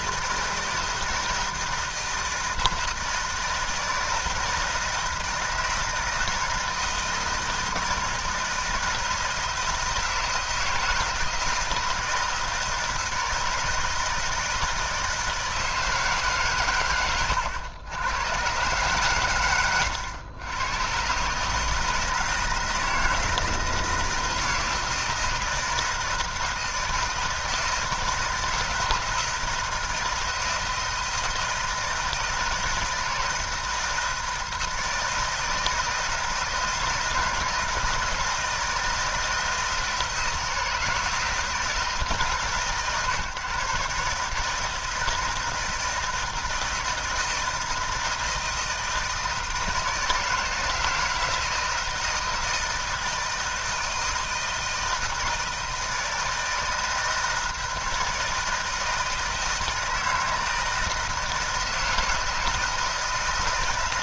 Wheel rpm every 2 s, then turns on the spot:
160, 160, 160, 160, 160, 160, 160, 160, 110, 130, 120, 160, 170, 160, 160, 160, 160, 160, 160, 160, 160, 140, 160, 160, 160, 160, 160, 160, 160, 160, 160, 160.
none